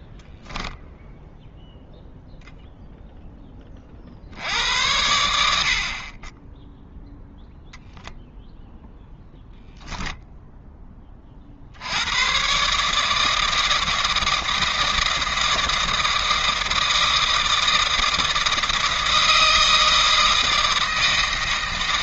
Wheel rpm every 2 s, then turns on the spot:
0, 0, 80, 10, 0, 10, 140, 160, 160, 160, 160.
none